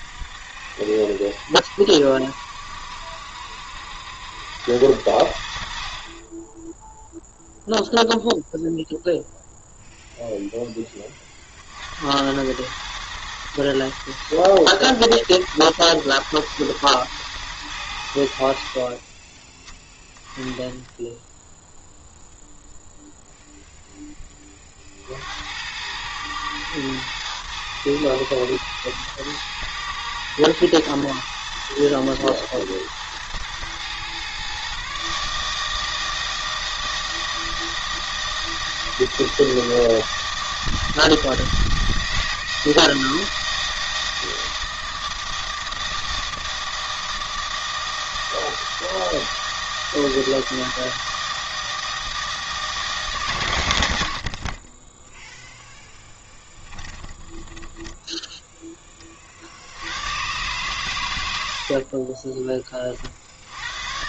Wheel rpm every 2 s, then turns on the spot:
60, 70, 90, 10, 0, 10, 100, 120, 110, 50, 10, 0, 40, 110, 110, 120, 110, 130, 160, 160, 160, 160, 160, 160, 160, 160, 160, 30, 10, 10, 120, 30.
54-58